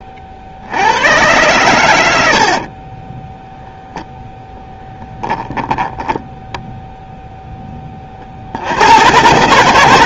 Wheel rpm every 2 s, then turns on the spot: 80, 40, 10, 0, 90.
2-6